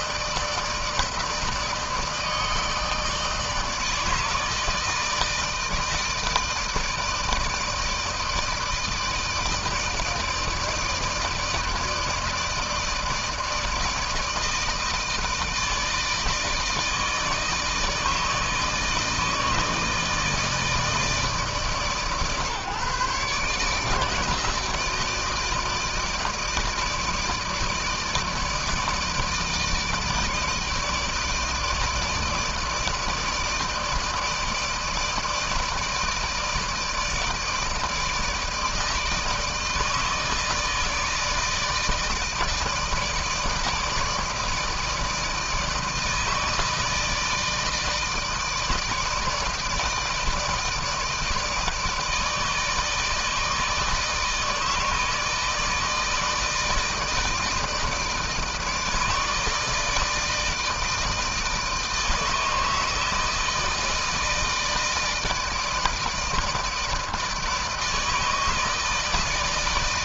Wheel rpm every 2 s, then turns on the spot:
160, 160, 160, 160, 160, 160, 160, 160, 160, 160, 150, 140, 160, 160, 160, 160, 160, 160, 160, 160, 160, 160, 160, 150, 160, 150, 160, 160, 160, 160, 160, 160, 160, 160, 160.
none